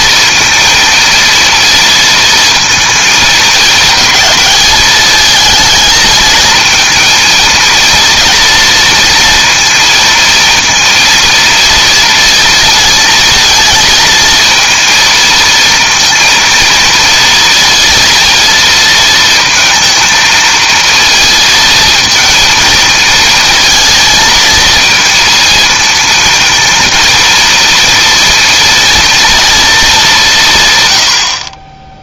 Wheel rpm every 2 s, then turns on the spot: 230, 230, 220, 230, 230, 230, 230, 230, 230, 230, 230, 230, 230, 230, 230, 130.
none